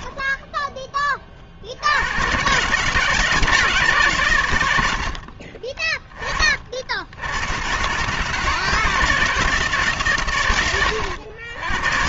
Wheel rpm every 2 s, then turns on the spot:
40, 150, 40, 70, 160, 100.
4-6